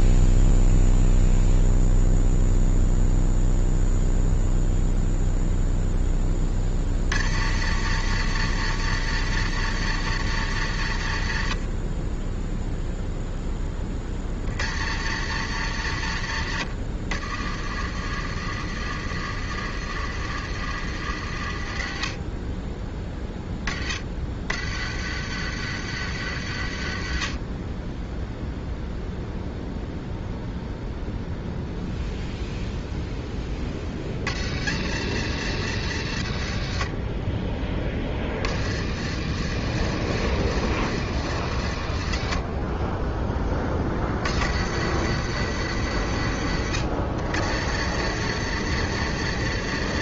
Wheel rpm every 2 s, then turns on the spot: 0, 0, 0, 40, 120, 100, 0, 80, 80, 80, 80, 20, 70, 70, 0, 0, 0, 90, 50, 60, 80, 20, 80, 70, 120.
none